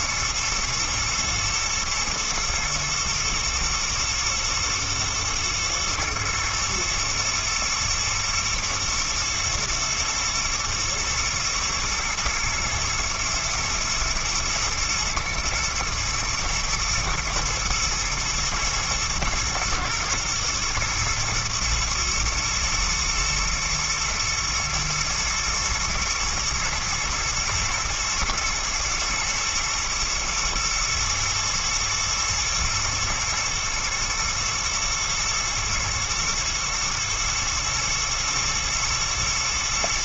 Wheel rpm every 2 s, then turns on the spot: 110, 110, 110, 110, 120, 110, 110, 120, 110, 110, 110, 110, 120, 120, 120, 110, 110, 120, 120, 110.
none